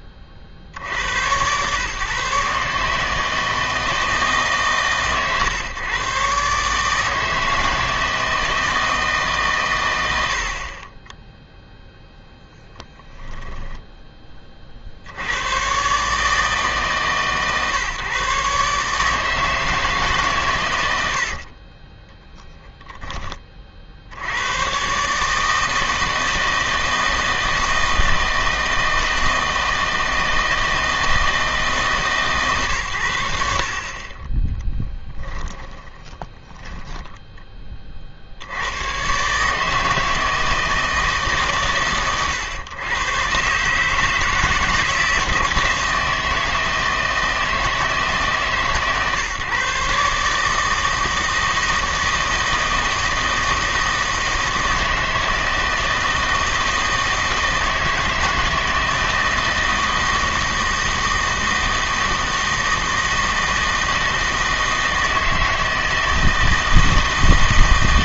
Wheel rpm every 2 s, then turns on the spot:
80, 140, 140, 150, 160, 30, 10, 40, 150, 150, 100, 10, 120, 160, 160, 160, 130, 10, 30, 90, 160, 110, 160, 160, 130, 160, 160, 160, 160, 160, 160, 160, 160, 160.
12-14 34-38